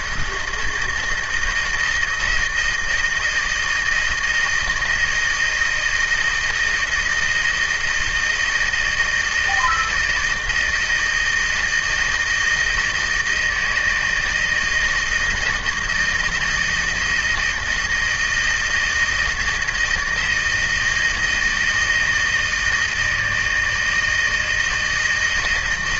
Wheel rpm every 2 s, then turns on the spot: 160, 160, 160, 160, 160, 160, 160, 160, 160, 160, 170, 160, 160.
none